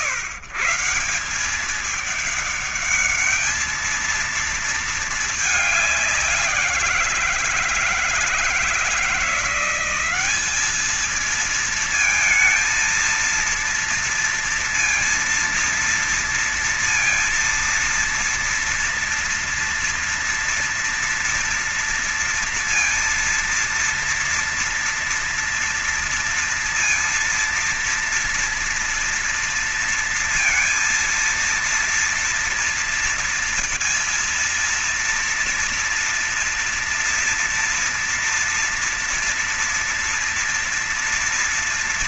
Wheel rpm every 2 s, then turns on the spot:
150, 210, 220, 180, 160, 200, 230, 230, 230, 230, 230, 230, 230, 230, 230, 230, 230, 230, 230, 240, 230.
none